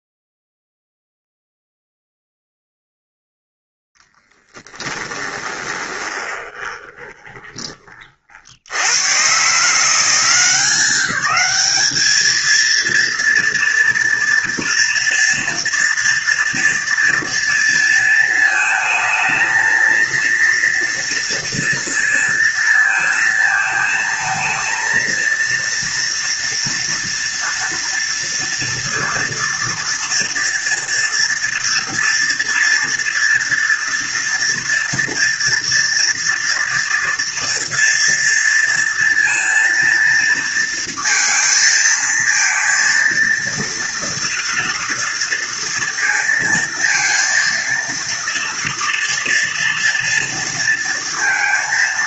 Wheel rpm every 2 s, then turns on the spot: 0, 0, 20, 20, 120, 190, 230, 230, 230, 220, 230, 230, 230, 230, 230, 240, 230, 230, 230, 230, 230, 230, 230, 230, 230, 230.
4-8